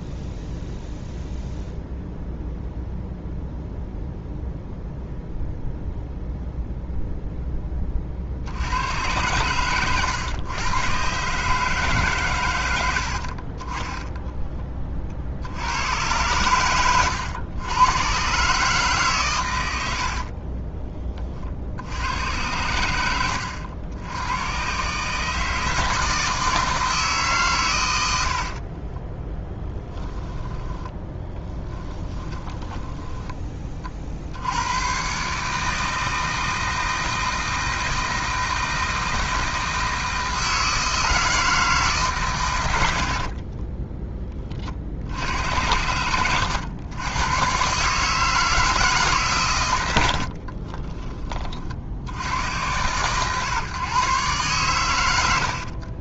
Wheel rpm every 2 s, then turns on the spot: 0, 0, 0, 0, 80, 120, 110, 30, 110, 140, 30, 100, 120, 160, 50, 10, 20, 90, 160, 160, 160, 120, 40, 100, 160, 40, 110, 110.
20-22 28-34 50-52